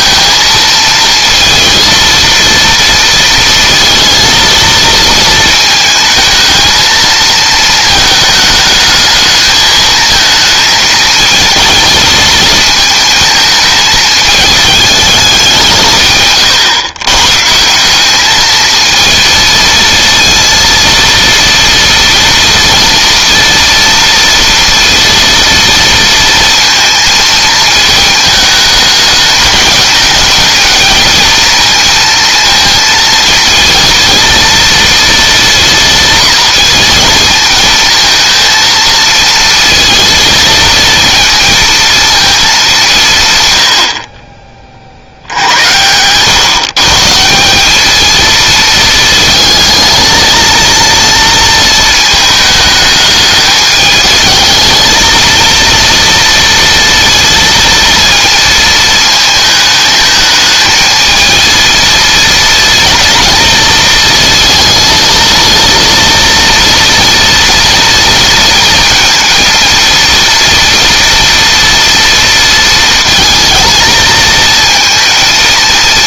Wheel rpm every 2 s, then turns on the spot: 230, 230, 220, 220, 220, 220, 220, 210, 120, 220, 230, 230, 230, 230, 210, 230, 230, 230, 230, 230, 230, 170, 60, 150, 220, 230, 210, 220, 230, 220, 220, 230, 230, 230, 230, 230, 230, 230.
none